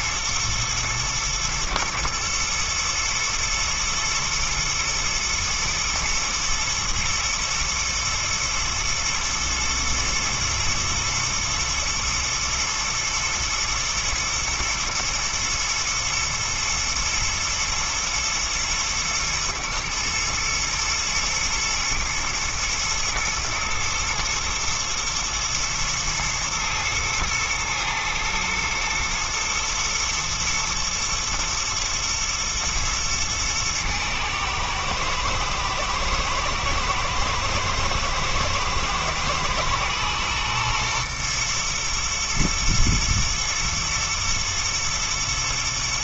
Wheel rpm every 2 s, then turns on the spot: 120, 120, 120, 120, 110, 110, 120, 120, 110, 110, 120, 120, 120, 110, 120, 110, 120, 110, 110, 110, 120, 120, 120.
none